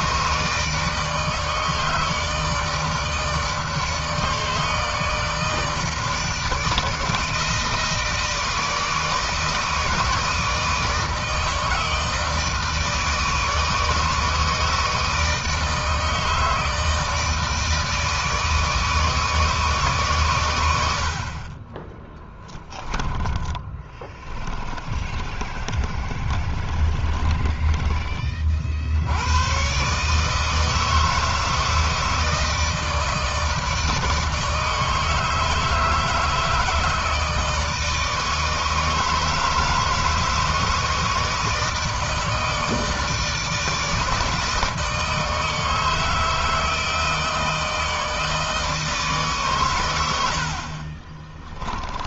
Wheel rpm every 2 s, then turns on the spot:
160, 150, 150, 160, 160, 160, 160, 160, 160, 160, 60, 20, 30, 20, 60, 160, 160, 160, 160, 160, 160, 160, 160, 160, 150, 40.
22-28 50-52